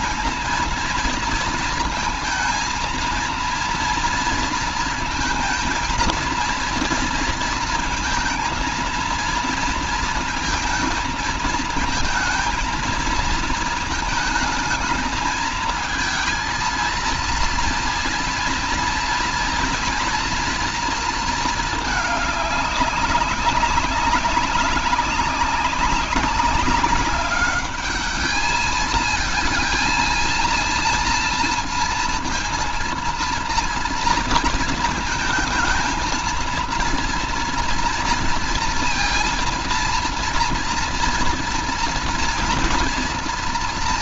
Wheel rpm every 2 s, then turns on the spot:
230, 230, 230, 230, 230, 220, 230, 220, 230, 230, 230, 200, 200, 200, 230, 230, 230, 220, 230, 230, 230, 230.
none